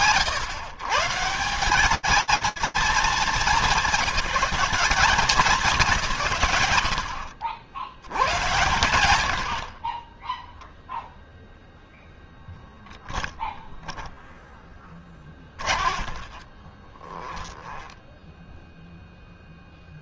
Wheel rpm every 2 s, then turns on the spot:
150, 210, 210, 70, 90, 0, 0, 20, 10, 0.
14-18